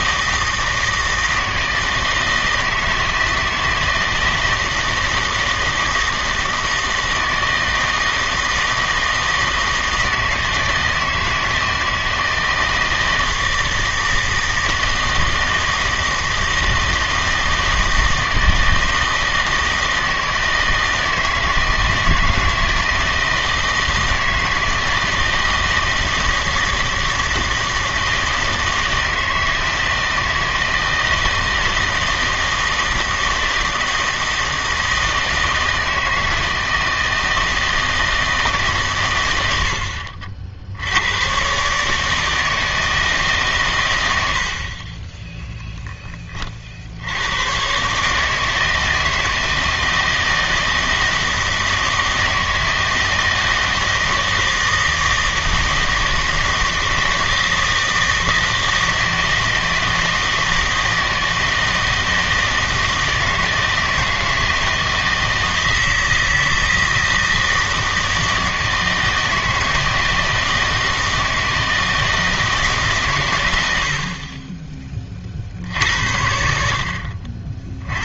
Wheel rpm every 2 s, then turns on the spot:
160, 160, 160, 160, 160, 160, 160, 160, 160, 160, 160, 160, 160, 160, 160, 160, 160, 160, 160, 140, 70, 160, 40, 60, 160, 160, 160, 160, 160, 160, 160, 160, 160, 160, 160, 160, 150, 20, 60.
none